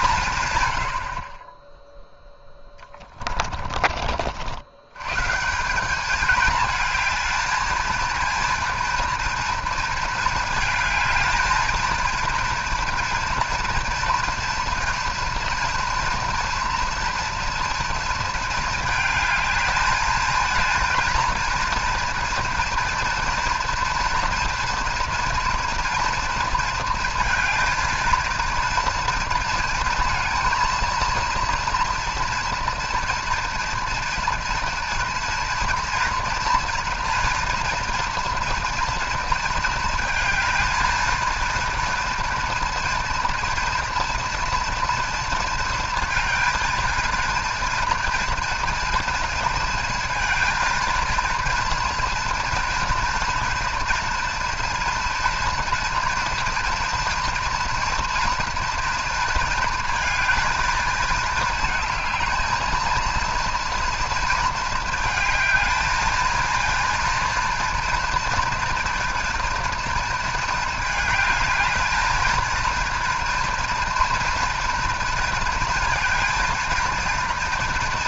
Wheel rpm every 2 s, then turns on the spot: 100, 10, 90, 220, 230, 220, 230, 230, 230, 220, 230, 230, 230, 230, 230, 230, 230, 230, 230, 240, 230, 230, 230, 230, 230, 230, 230, 240, 230, 230, 220, 220, 230, 230, 230, 220, 230, 230, 230.
2-4